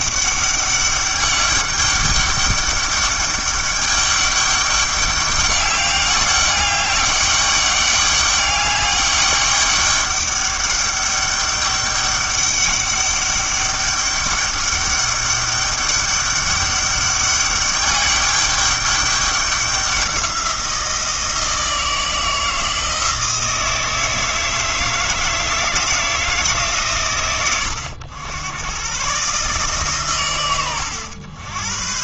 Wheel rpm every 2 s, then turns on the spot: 200, 200, 200, 200, 200, 200, 200, 200, 200, 200, 170, 160, 160, 130, 120, 100.
none